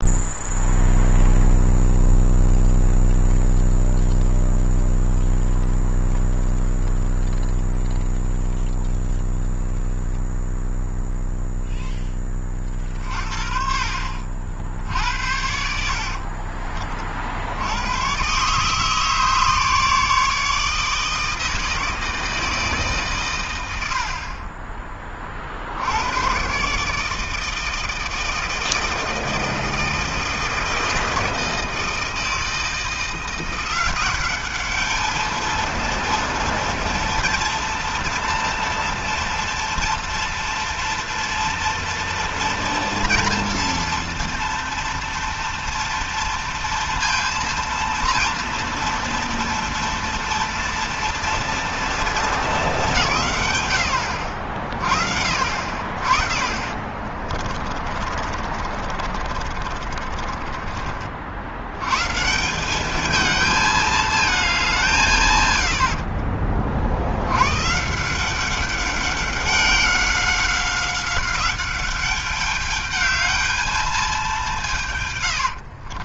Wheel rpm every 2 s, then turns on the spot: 0, 0, 0, 0, 0, 0, 50, 60, 80, 150, 160, 100, 60, 160, 160, 160, 180, 220, 240, 230, 230, 230, 230, 230, 230, 230, 160, 70, 30, 30, 80, 220, 110, 110, 200, 190, 220, 70.
56-60 74-76